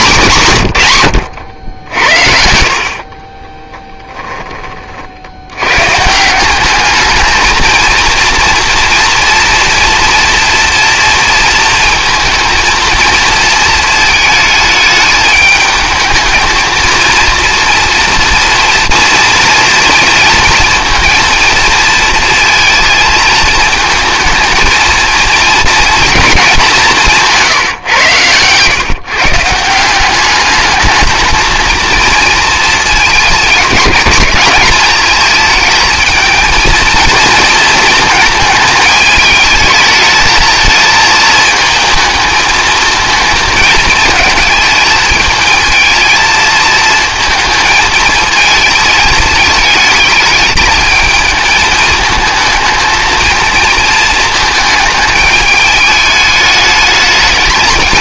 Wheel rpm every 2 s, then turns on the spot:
130, 60, 40, 200, 230, 230, 230, 220, 230, 230, 230, 220, 220, 190, 130, 210, 220, 210, 230, 220, 220, 220, 220, 220, 220, 220, 220, 220, 210.
none